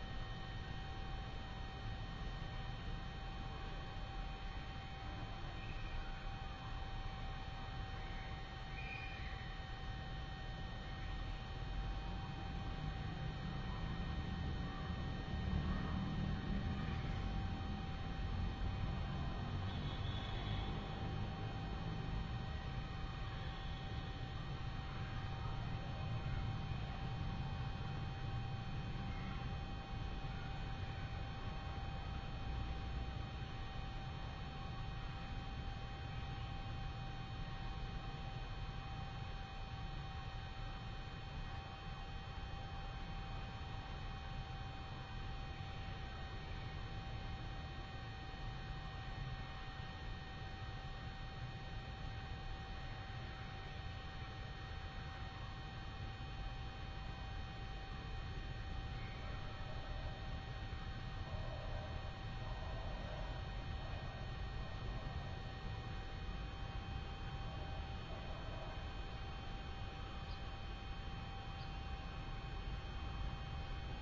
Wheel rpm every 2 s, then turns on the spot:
0, 0, 0, 0, 0, 0, 0, 0, 0, 0, 0, 0, 0, 0, 0, 0, 0, 0, 0, 0, 0, 0, 0, 0, 0, 0, 0, 0, 0, 0, 0, 0, 0, 0, 0, 0, 0.
none